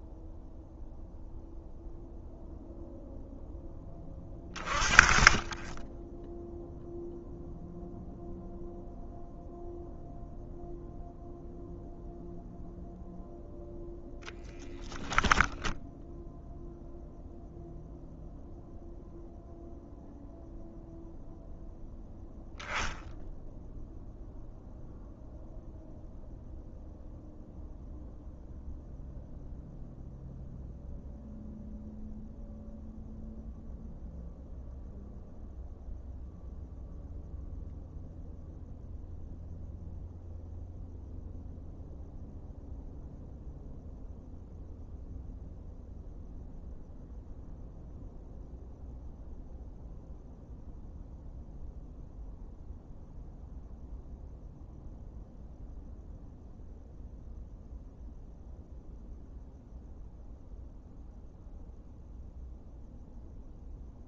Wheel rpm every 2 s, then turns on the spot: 0, 0, 20, 0, 0, 0, 0, 0, 0, 0, 0, 10, 0, 0, 0, 0, 0, 0, 0, 0, 0, 0, 0, 0, 0, 0, 0, 0, 0, 0, 0, 0.
none